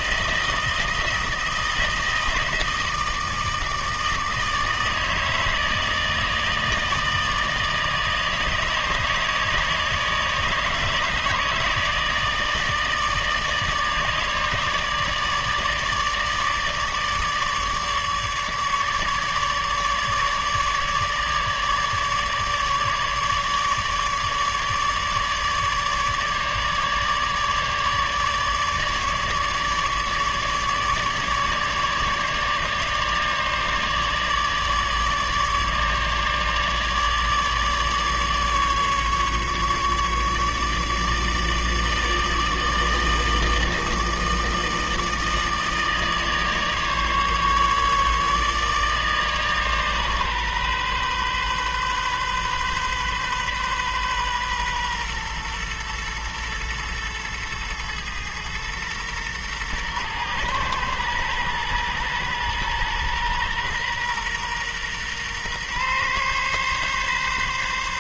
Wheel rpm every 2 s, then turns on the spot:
160, 160, 160, 160, 150, 150, 160, 150, 150, 150, 150, 150, 150, 150, 150, 150, 150, 150, 150, 150, 150, 160, 160, 150, 150, 130, 130, 130, 120, 110, 120, 120, 120, 130.
none